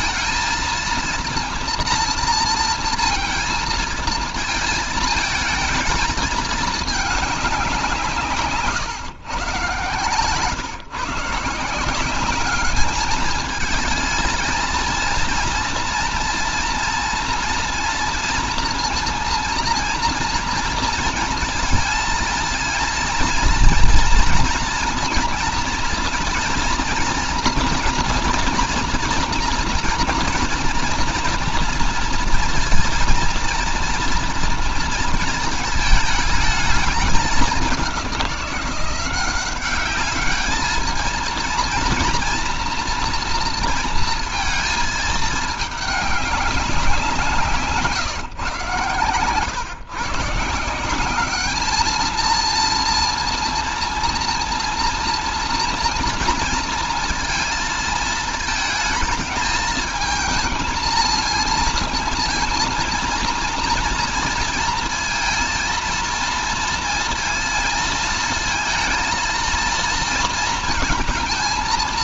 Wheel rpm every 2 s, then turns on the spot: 230, 230, 220, 220, 150, 150, 210, 230, 230, 230, 230, 230, 230, 230, 230, 230, 230, 230, 210, 180, 220, 230, 220, 190, 130, 170, 230, 230, 230, 220, 220, 230, 230, 230, 230, 230.
none